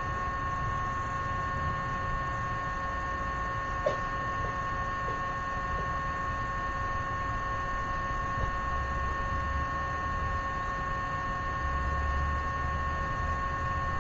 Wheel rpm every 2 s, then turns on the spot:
0, 0, 0, 0, 0, 0, 0.
none